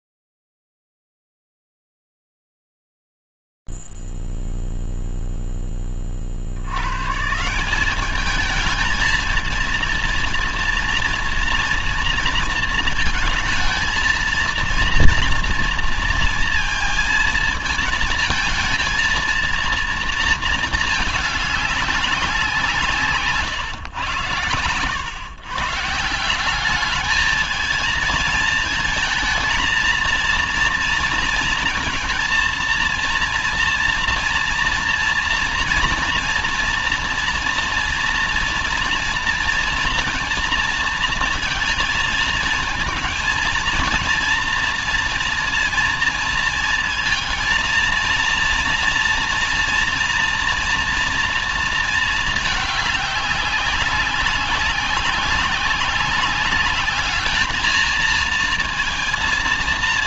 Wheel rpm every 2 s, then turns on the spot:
0, 0, 0, 70, 210, 230, 230, 230, 230, 220, 220, 170, 110, 180, 220, 230, 230, 230, 230, 230, 240, 230, 230, 220, 230, 240, 210, 190, 210, 230.
none